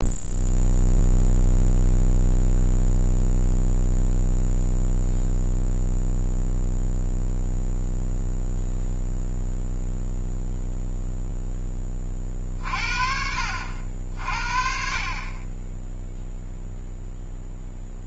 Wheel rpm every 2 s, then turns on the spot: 0, 0, 0, 0, 0, 0, 40, 50, 0.
none